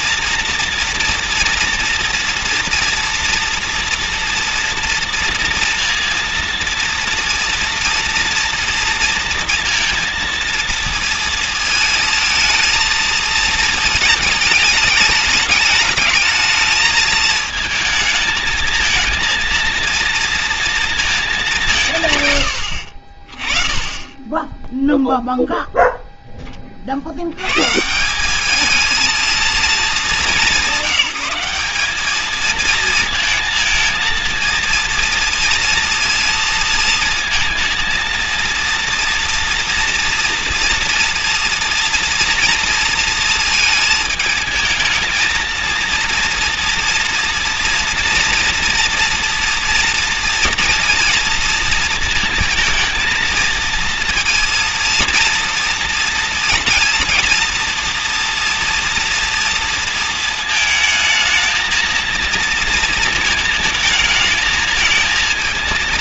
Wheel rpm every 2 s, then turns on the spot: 240, 230, 230, 230, 240, 230, 230, 210, 220, 220, 230, 70, 0, 20, 210, 190, 220, 230, 230, 230, 230, 230, 220, 230, 230, 230, 230, 230, 230, 230, 220, 230, 220.
none